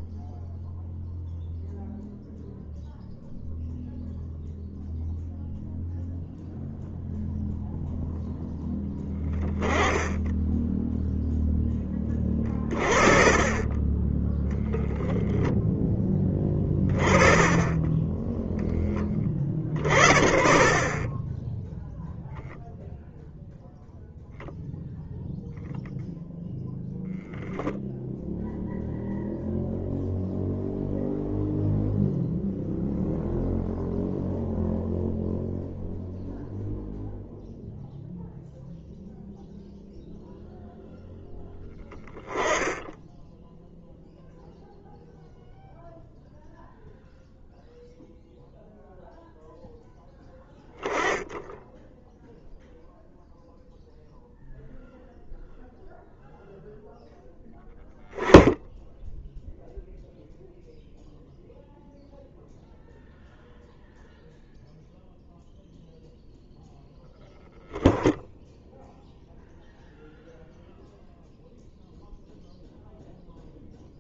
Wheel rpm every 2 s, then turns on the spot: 0, 0, 0, 0, 0, 0, 20, 10, 20, 10, 20, 0, 0, 0, 0, 0, 0, 0, 0, 0, 0, 10, 0, 0, 0, 10, 0, 0, 0, 0, 0, 0, 0, 0, 0, 0, 0.
16-18